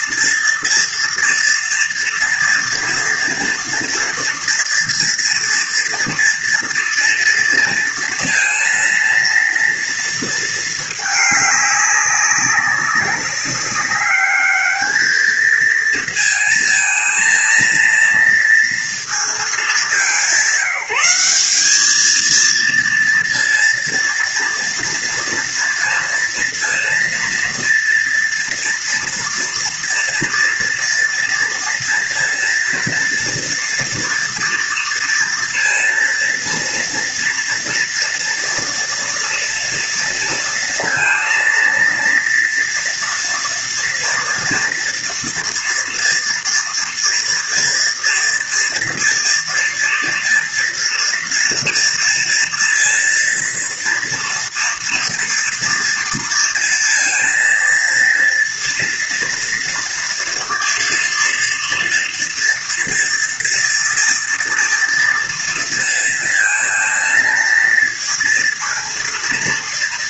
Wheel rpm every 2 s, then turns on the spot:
230, 230, 230, 230, 230, 220, 190, 210, 220, 230, 170, 230, 230, 230, 230, 230, 230, 230, 230, 230, 230, 240, 230, 230, 230, 230, 230, 230, 230, 230, 230, 240, 230, 230, 230.
none